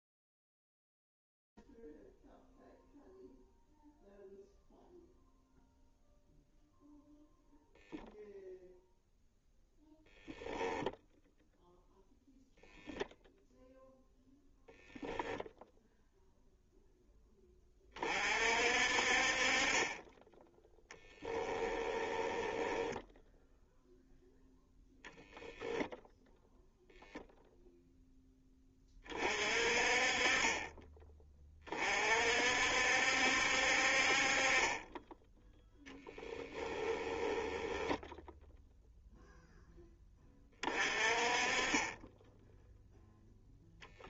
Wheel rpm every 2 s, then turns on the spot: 0, 0, 0, 0, 0, 0, 0, 10, 0, 50, 10, 10, 0, 0, 30, 20, 60, 20, 10, 0, 30, 0.
22-24 36-38